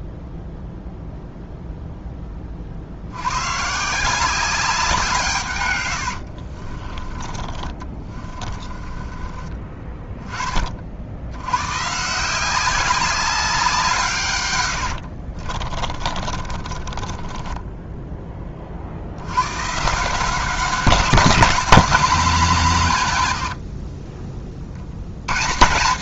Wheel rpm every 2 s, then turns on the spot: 0, 60, 180, 40, 30, 40, 190, 90, 20, 40, 190, 170, 70.
6-10 14-18